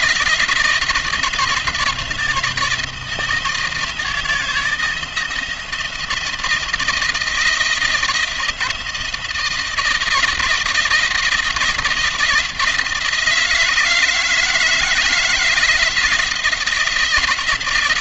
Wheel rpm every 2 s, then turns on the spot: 160, 170, 160, 160, 170, 170, 160, 160, 160.
none